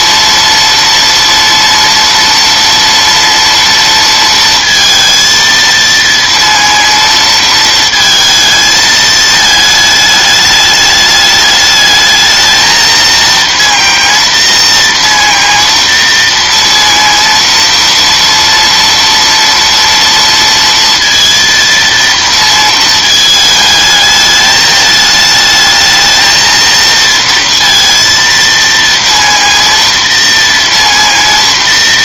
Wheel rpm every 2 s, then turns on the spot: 230, 230, 230, 230, 220, 210, 220, 230, 230, 240, 230, 230, 210, 230, 230, 230.
none